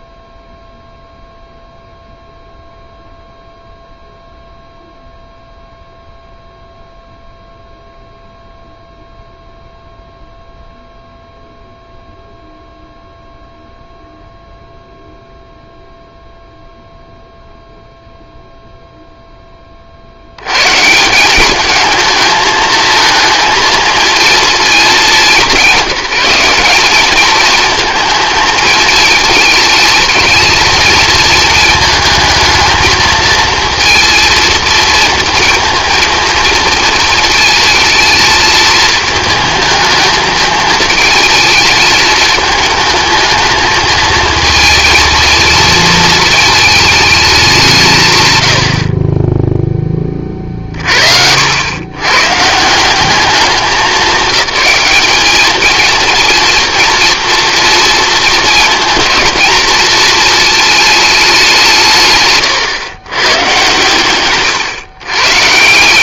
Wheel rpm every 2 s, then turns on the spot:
0, 0, 0, 0, 0, 0, 0, 0, 0, 0, 130, 220, 220, 200, 220, 220, 220, 220, 230, 220, 220, 220, 230, 220, 70, 50, 160, 200, 230, 220, 220, 120, 130.
none